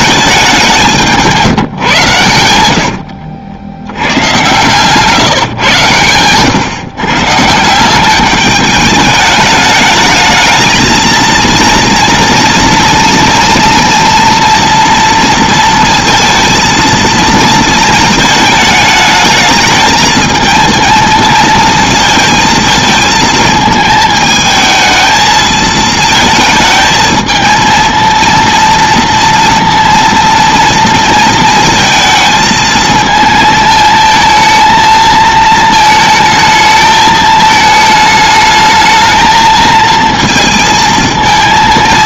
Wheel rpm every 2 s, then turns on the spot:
190, 90, 120, 120, 200, 220, 230, 240, 230, 220, 220, 220, 220, 220, 230, 230, 220, 220, 220, 210, 230.
2-4